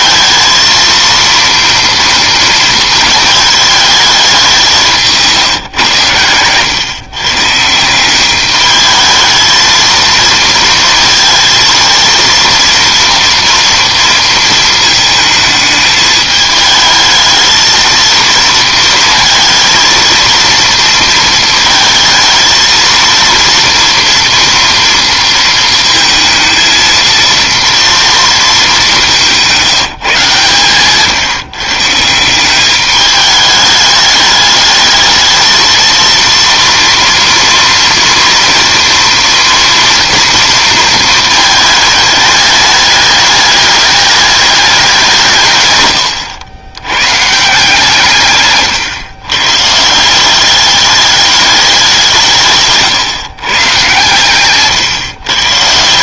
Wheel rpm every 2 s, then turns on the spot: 230, 230, 180, 120, 210, 230, 230, 220, 220, 230, 230, 230, 230, 230, 210, 140, 200, 210, 230, 230, 230, 210, 200, 90, 120, 200, 150, 140.
52-54